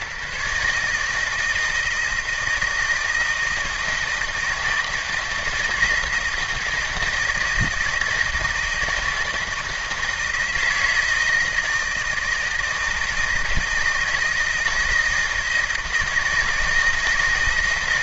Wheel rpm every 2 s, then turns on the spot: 150, 160, 160, 160, 160, 160, 160, 160, 160.
none